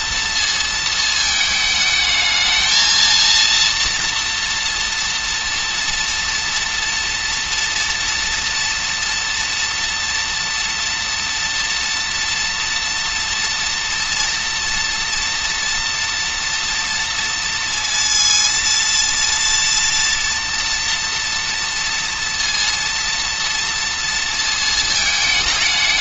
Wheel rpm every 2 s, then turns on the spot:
230, 230, 240, 240, 230, 240, 230, 230, 230, 230, 230, 230, 220.
none